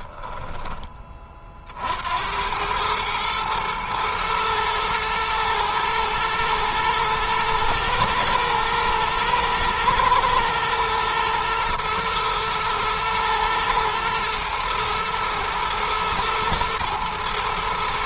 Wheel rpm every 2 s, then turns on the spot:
20, 110, 110, 110, 110, 120, 120, 110, 110.
none